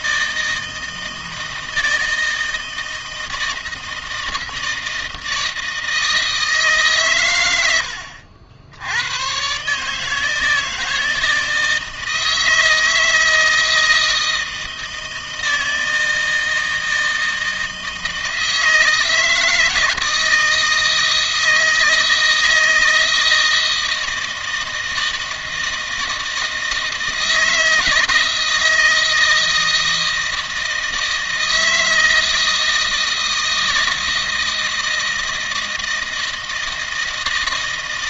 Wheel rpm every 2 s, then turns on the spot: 160, 160, 160, 150, 90, 160, 160, 160, 160, 160, 160, 160, 160, 160, 160, 160, 160, 160, 160.
none